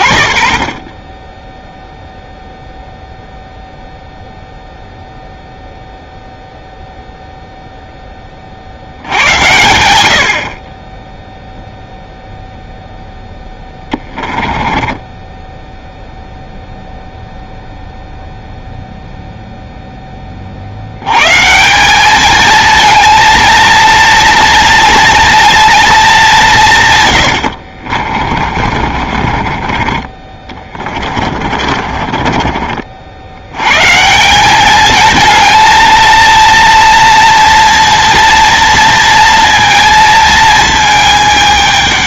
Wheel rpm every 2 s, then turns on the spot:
30, 0, 0, 0, 50, 30, 0, 20, 0, 0, 80, 220, 230, 170, 40, 30, 40, 200, 230, 230, 220.
14-16 28-32